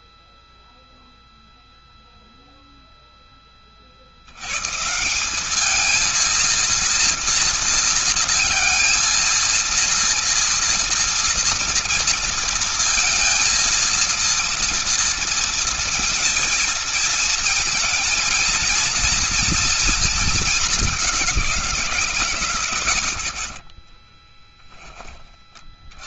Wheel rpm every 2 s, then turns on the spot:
0, 0, 110, 230, 230, 230, 230, 230, 220, 230, 220, 140, 10.
none